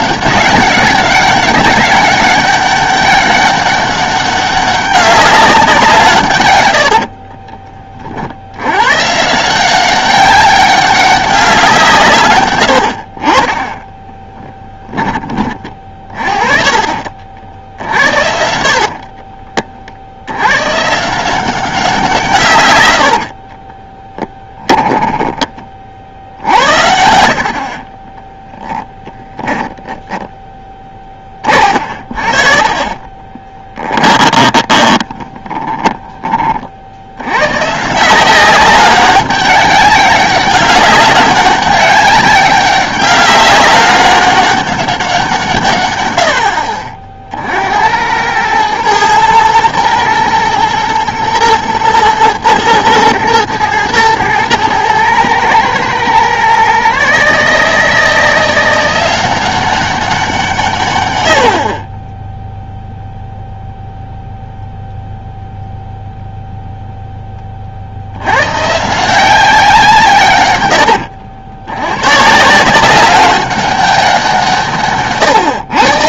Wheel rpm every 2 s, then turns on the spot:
200, 200, 200, 90, 120, 200, 60, 20, 50, 60, 140, 100, 10, 80, 10, 10, 30, 20, 70, 200, 200, 200, 200, 50, 110, 110, 120, 110, 140, 170, 140, 0, 0, 0, 150, 90, 180, 140.
6-8 14-16 18-20 24-26 32-36